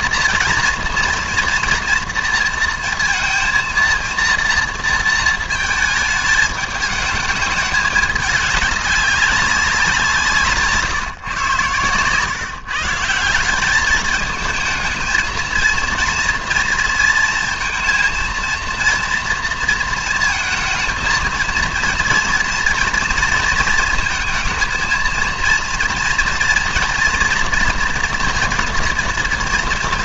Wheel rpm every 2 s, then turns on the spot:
230, 230, 230, 220, 200, 150, 150, 220, 230, 230, 230, 230, 220, 230, 230.
none